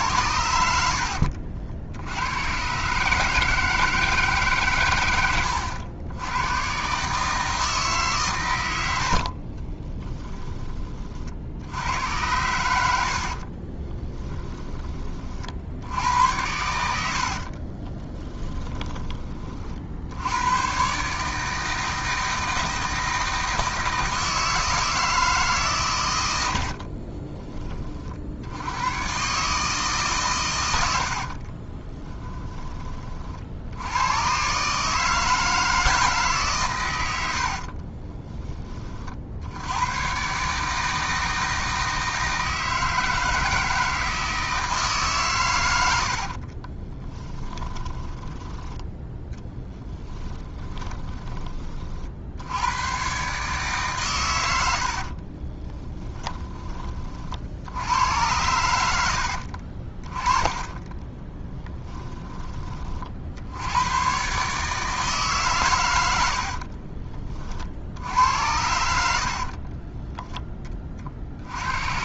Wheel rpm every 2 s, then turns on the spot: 70, 140, 110, 140, 80, 30, 70, 20, 80, 20, 130, 160, 160, 50, 110, 80, 30, 150, 100, 40, 160, 160, 150, 20, 10, 20, 110, 60, 20, 80, 20, 40, 150, 40, 80, 50.
0-2 12-14 26-28 30-32 46-48 50-52 54-56 60-62 66-68